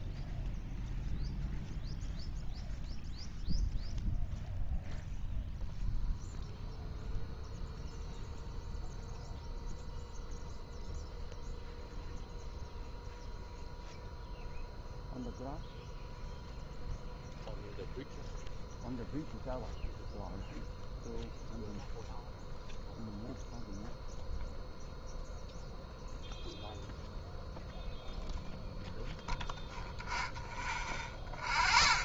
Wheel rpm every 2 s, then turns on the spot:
0, 0, 0, 0, 0, 0, 0, 0, 0, 0, 0, 0, 0, 0, 0, 0.
none